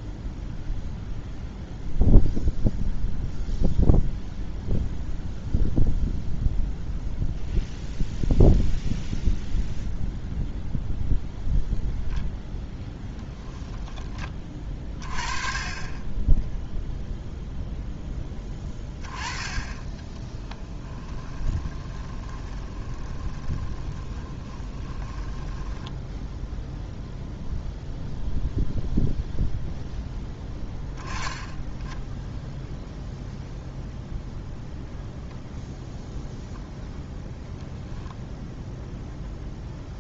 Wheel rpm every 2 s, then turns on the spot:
0, 0, 0, 0, 0, 0, 0, 30, 0, 20, 30, 20, 30, 0, 0, 10, 0, 0, 0, 0.
20-26